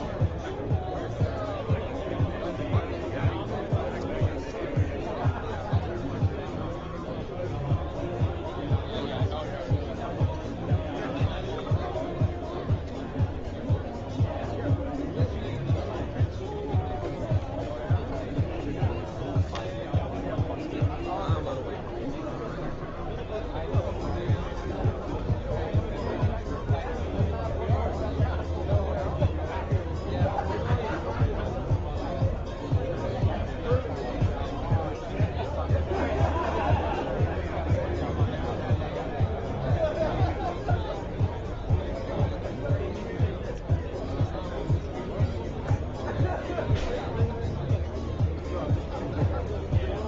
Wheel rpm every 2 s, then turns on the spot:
0, 0, 0, 0, 0, 0, 0, 0, 0, 0, 0, 0, 0, 0, 0, 0, 0, 0, 0, 0, 0, 0, 0, 0, 0.
none